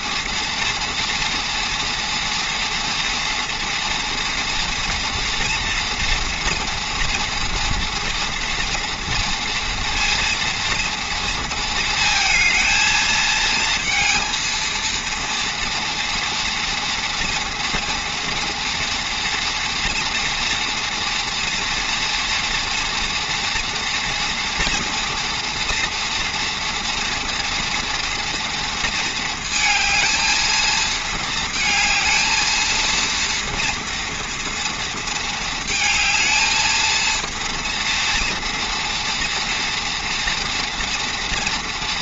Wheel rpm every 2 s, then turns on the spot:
230, 230, 240, 230, 230, 230, 220, 230, 230, 230, 230, 230, 230, 240, 230, 220, 220, 230, 230, 230, 230.
none